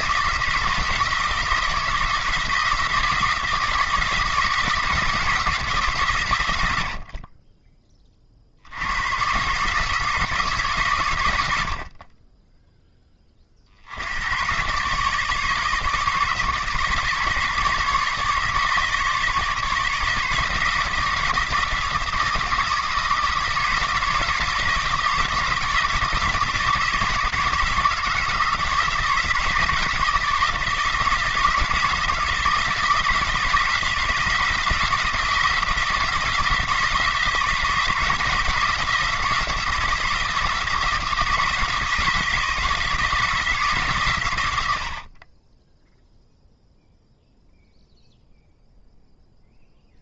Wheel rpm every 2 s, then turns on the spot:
160, 170, 170, 80, 90, 140, 10, 120, 150, 150, 160, 160, 160, 160, 160, 160, 170, 160, 160, 170, 160, 160, 90, 0, 0.
none